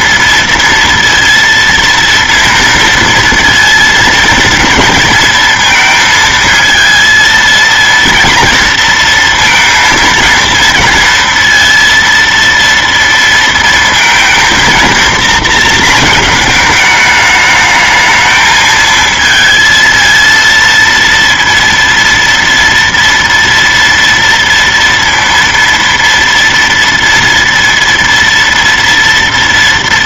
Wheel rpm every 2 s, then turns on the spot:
230, 230, 230, 230, 230, 230, 230, 230, 220, 220, 230, 230, 230, 230, 230.
none